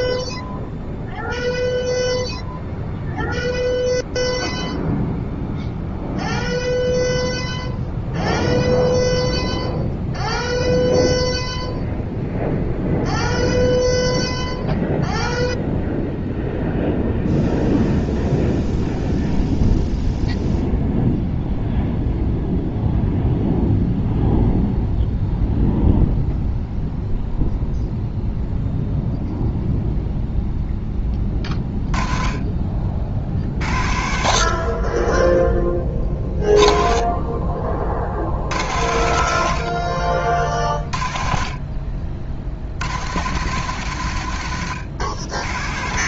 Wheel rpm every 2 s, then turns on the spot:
0, 0, 0, 0, 0, 0, 0, 0, 0, 0, 0, 0, 0, 0, 0, 10, 50, 40, 20, 80, 50, 70, 100.
none